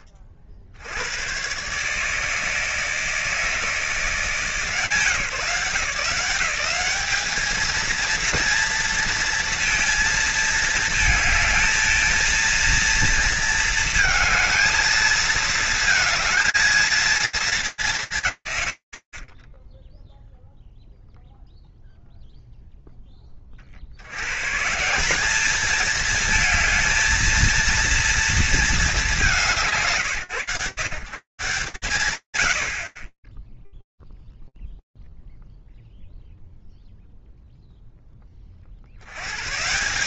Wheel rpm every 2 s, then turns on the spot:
40, 160, 160, 180, 230, 220, 230, 220, 230, 90, 0, 10, 170, 220, 210, 140, 100, 0, 0, 120.
none